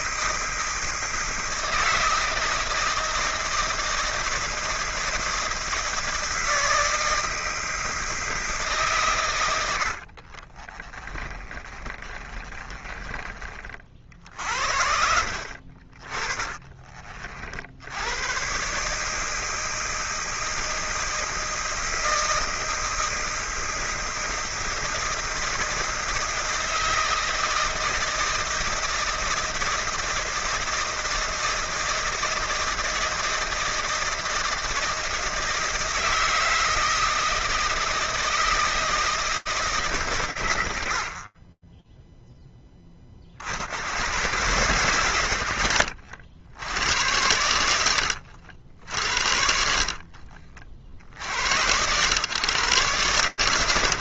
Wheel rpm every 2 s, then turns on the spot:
160, 160, 160, 160, 160, 40, 30, 60, 30, 120, 160, 160, 160, 160, 160, 160, 160, 160, 160, 160, 70, 10, 130, 90, 60, 70, 120.
10-14 16-18